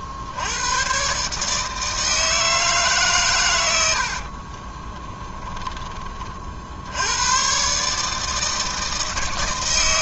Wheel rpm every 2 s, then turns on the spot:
80, 160, 40, 50, 160.
4-6